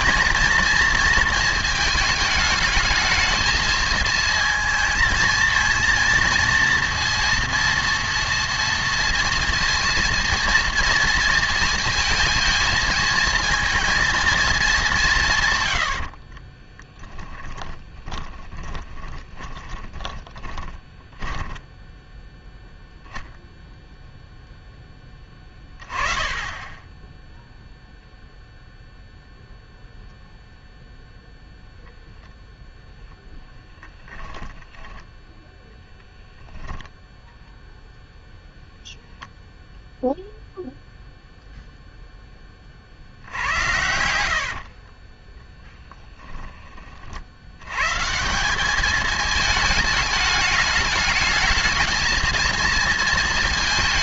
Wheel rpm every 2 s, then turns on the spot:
220, 220, 220, 230, 230, 230, 230, 190, 10, 20, 20, 0, 10, 10, 0, 0, 0, 10, 10, 0, 0, 60, 40, 50, 210, 210, 230.
16-22 36-38 44-46